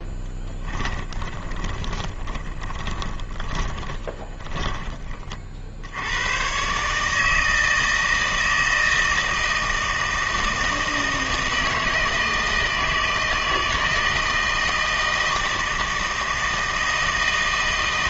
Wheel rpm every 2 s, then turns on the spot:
10, 20, 10, 140, 160, 160, 160, 160, 160.
0-4